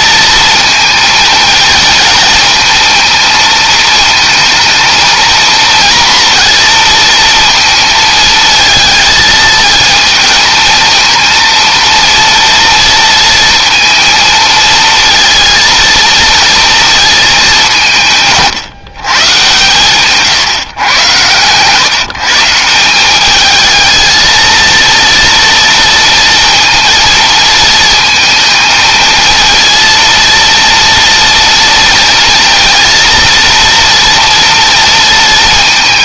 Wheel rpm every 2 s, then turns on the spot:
230, 230, 220, 230, 220, 230, 230, 230, 220, 130, 120, 180, 230, 230, 220, 230, 230, 230.
none